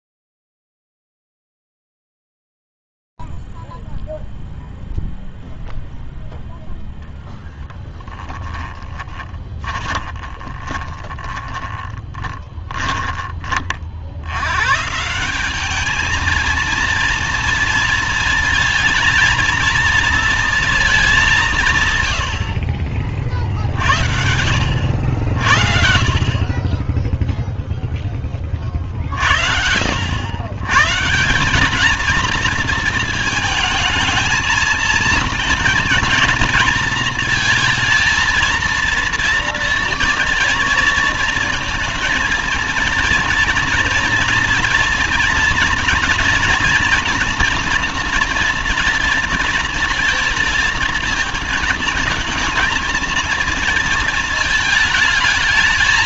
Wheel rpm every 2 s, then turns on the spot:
0, 0, 0, 0, 30, 20, 20, 110, 220, 230, 220, 60, 60, 30, 40, 140, 220, 220, 230, 230, 230, 230, 230, 230, 230, 220, 230, 220.
8-14